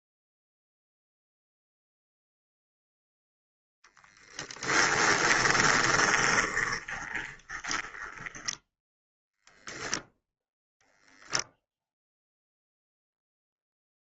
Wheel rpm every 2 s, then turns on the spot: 0, 0, 10, 20, 10, 0, 0.
4-8